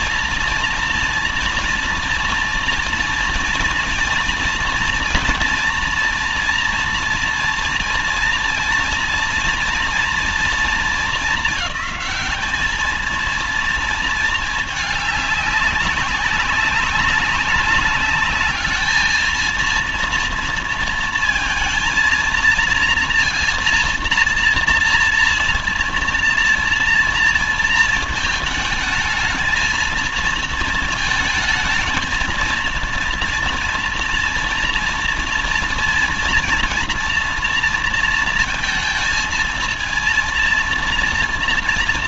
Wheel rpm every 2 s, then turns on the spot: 230, 230, 230, 230, 230, 230, 220, 210, 190, 210, 230, 230, 230, 230, 220, 220, 230, 230, 230, 230, 230.
none